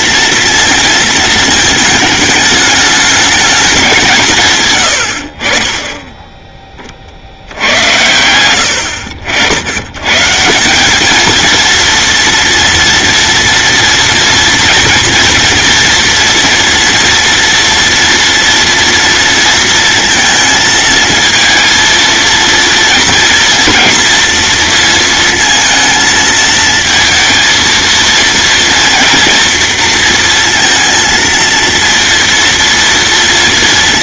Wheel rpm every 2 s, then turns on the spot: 230, 210, 110, 30, 80, 190, 230, 230, 230, 230, 230, 230, 230, 220, 230, 230, 230.
none